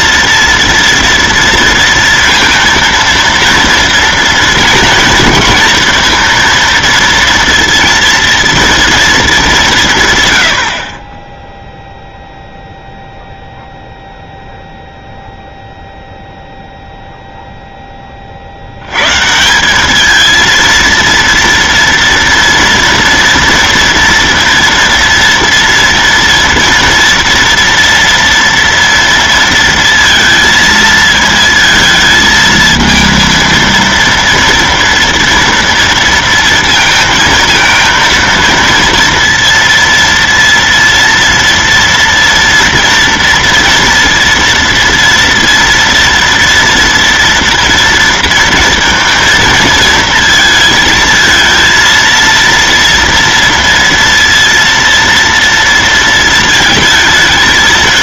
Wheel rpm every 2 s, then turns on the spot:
230, 230, 230, 230, 230, 90, 0, 0, 0, 70, 230, 230, 230, 230, 230, 230, 220, 230, 230, 230, 230, 230, 230, 240, 230, 220, 230, 230, 220.
none